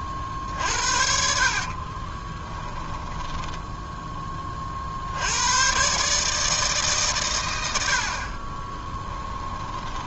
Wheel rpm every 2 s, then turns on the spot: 50, 10, 30, 150, 30.
2-4